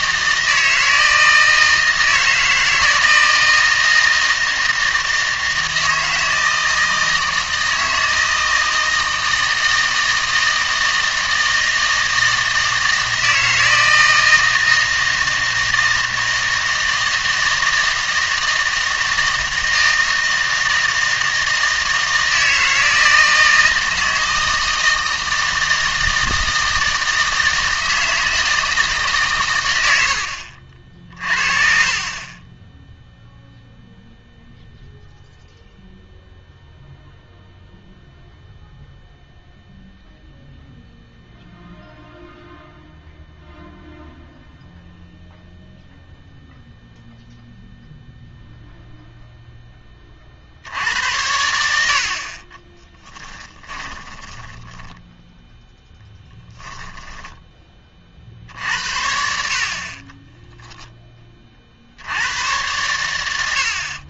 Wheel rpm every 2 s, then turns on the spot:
160, 160, 160, 160, 160, 160, 160, 160, 160, 160, 160, 160, 160, 160, 160, 60, 10, 0, 0, 0, 0, 0, 0, 0, 0, 70, 30, 20, 20, 60, 10, 110.
52-58